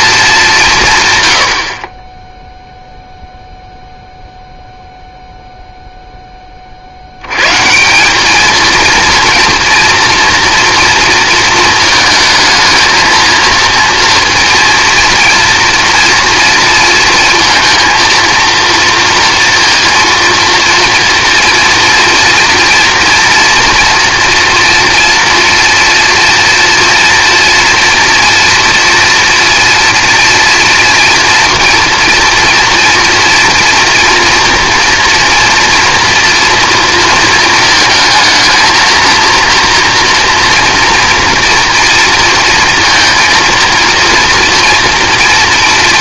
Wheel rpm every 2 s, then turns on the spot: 180, 0, 0, 40, 230, 230, 220, 230, 230, 230, 230, 230, 230, 230, 230, 230, 230, 230, 230, 230, 240, 230, 230.
none